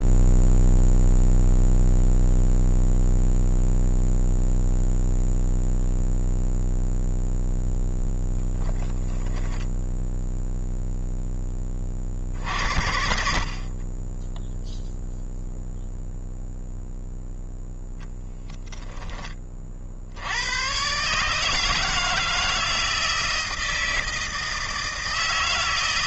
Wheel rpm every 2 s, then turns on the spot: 0, 0, 0, 0, 0, 0, 60, 0, 0, 10, 130, 160, 160.
none